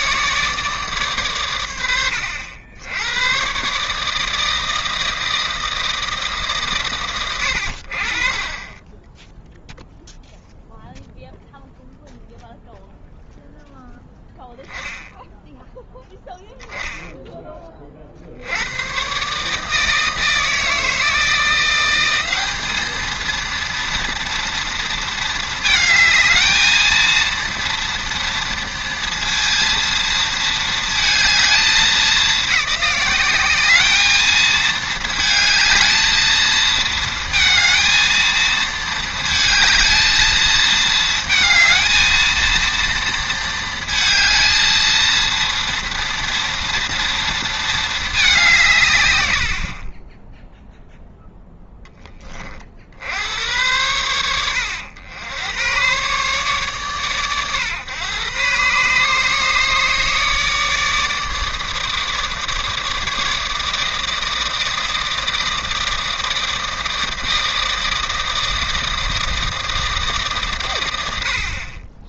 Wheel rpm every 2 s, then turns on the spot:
150, 80, 160, 120, 20, 0, 0, 0, 0, 100, 160, 220, 230, 220, 230, 220, 200, 220, 220, 220, 220, 230, 230, 230, 160, 0, 40, 80, 130, 130, 150, 150, 160, 160, 160, 110.
none